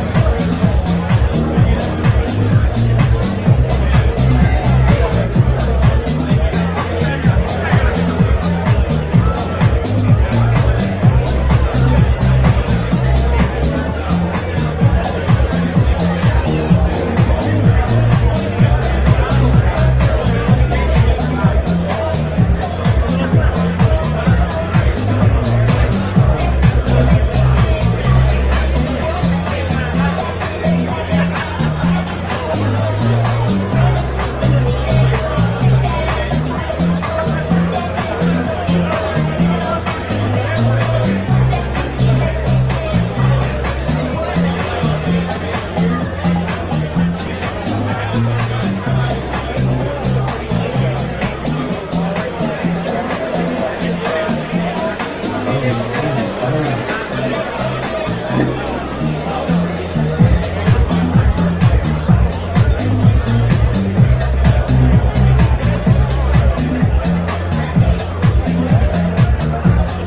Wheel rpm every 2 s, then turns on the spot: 0, 0, 0, 0, 0, 0, 0, 0, 0, 0, 0, 0, 0, 0, 0, 0, 0, 0, 0, 0, 0, 0, 0, 0, 0, 0, 0, 0, 0, 0, 0, 0, 0, 0, 0.
none